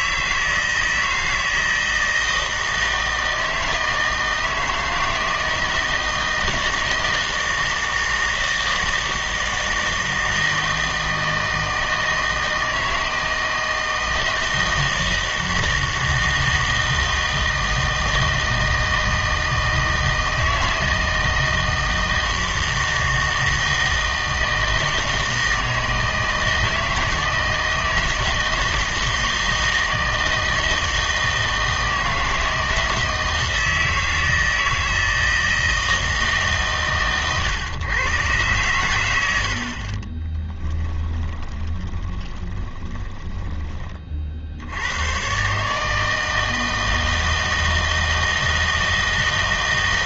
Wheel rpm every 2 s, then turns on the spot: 160, 160, 160, 160, 160, 160, 160, 160, 160, 160, 160, 160, 160, 160, 160, 160, 160, 160, 140, 110, 10, 20, 80, 160, 160.
40-44